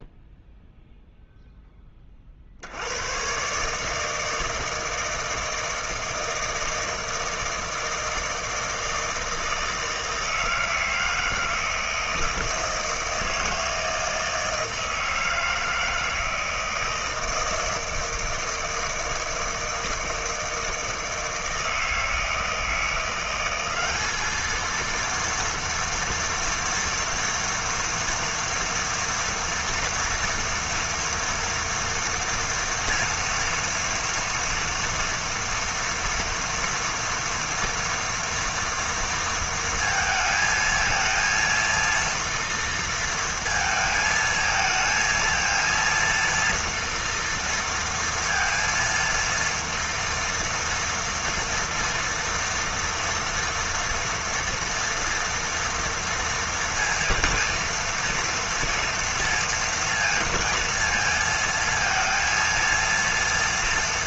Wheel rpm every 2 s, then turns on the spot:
0, 80, 160, 160, 160, 160, 160, 160, 160, 160, 160, 170, 230, 240, 230, 230, 230, 230, 230, 230, 220, 230, 220, 230, 230, 230, 230, 230, 230, 230, 230, 230.
none